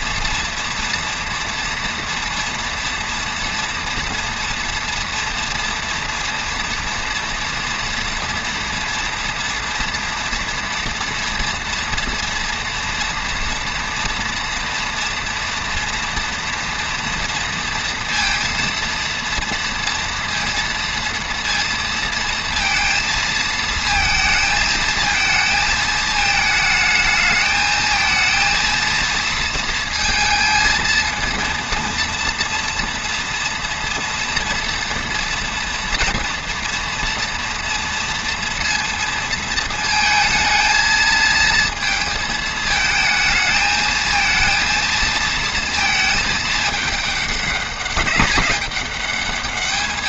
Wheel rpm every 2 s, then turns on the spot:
240, 230, 230, 240, 240, 230, 240, 230, 230, 230, 230, 230, 220, 220, 230, 230, 240, 230, 230, 230, 230, 220, 230, 200, 200.
none